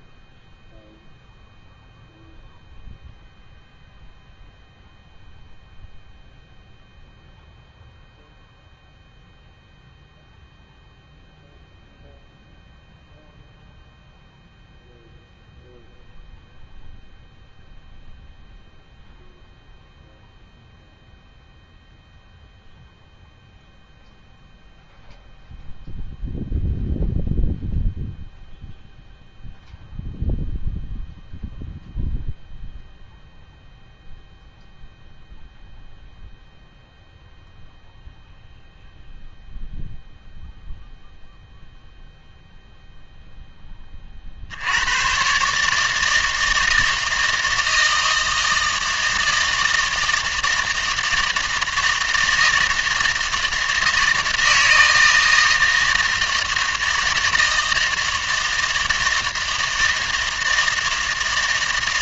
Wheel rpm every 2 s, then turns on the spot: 0, 0, 0, 0, 0, 0, 0, 0, 0, 0, 0, 0, 0, 0, 0, 0, 0, 0, 0, 0, 0, 0, 80, 160, 160, 160, 160, 160, 160, 160, 160.
none